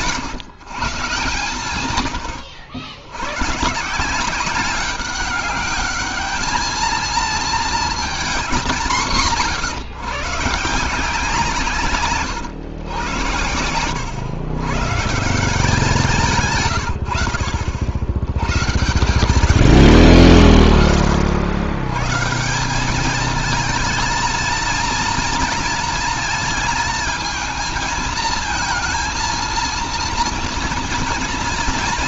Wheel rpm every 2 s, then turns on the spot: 160, 100, 200, 220, 200, 160, 110, 120, 130, 110, 40, 190, 220, 220, 220, 230.
none